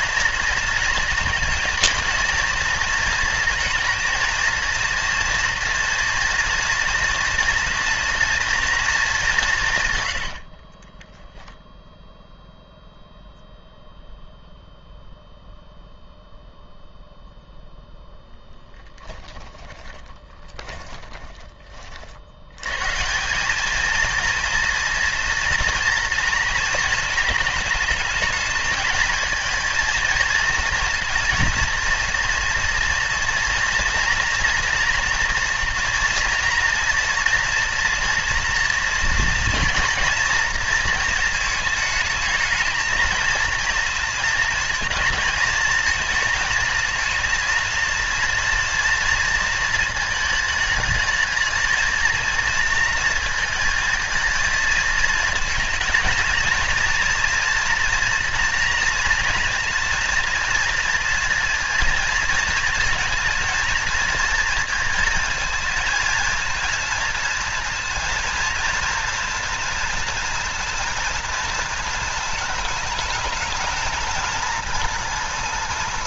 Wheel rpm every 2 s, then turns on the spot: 230, 230, 230, 230, 230, 40, 0, 0, 0, 10, 20, 110, 230, 230, 230, 230, 230, 240, 240, 230, 230, 220, 220, 220, 230, 210, 230, 220, 230, 230, 230, 230, 220, 230, 230, 230, 220, 220.
10-12 18-22